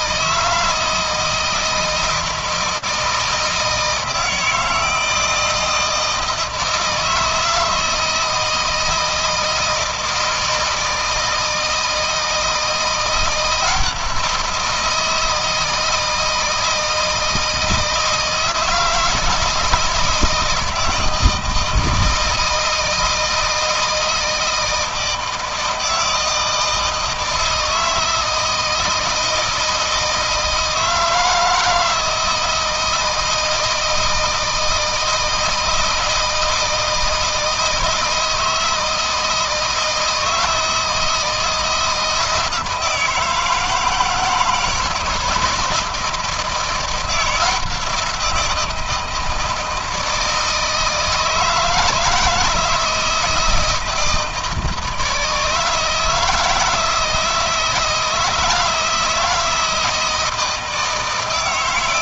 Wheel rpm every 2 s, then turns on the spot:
160, 170, 160, 160, 160, 160, 170, 170, 160, 160, 160, 160, 160, 160, 160, 160, 160, 160, 160, 160, 160, 160, 160, 170, 170, 160, 160, 160, 160, 160, 160.
none